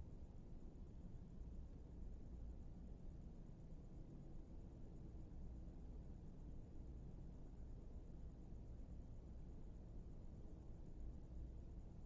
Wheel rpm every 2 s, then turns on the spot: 0, 0, 0, 0, 0, 0.
none